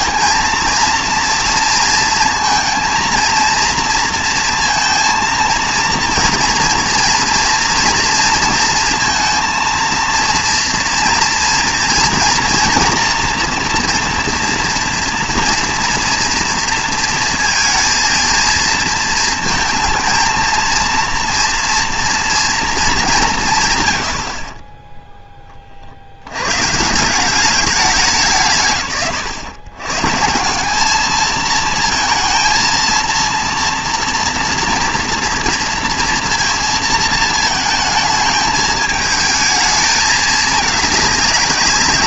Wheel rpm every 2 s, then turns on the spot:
230, 230, 230, 230, 230, 230, 230, 230, 230, 230, 230, 230, 40, 120, 140, 180, 230, 230, 230, 220, 210.
none